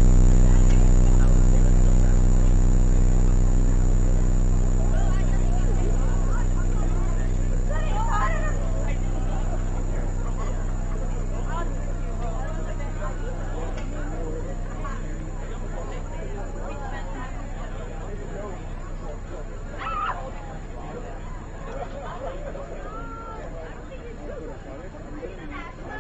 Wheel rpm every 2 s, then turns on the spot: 0, 0, 0, 0, 0, 0, 0, 0, 0, 0, 0, 0, 0.
none